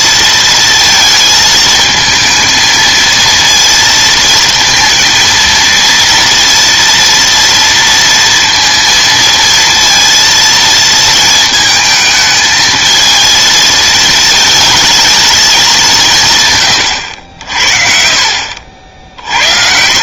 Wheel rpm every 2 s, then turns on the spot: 230, 220, 230, 230, 230, 230, 220, 220, 130, 50.
none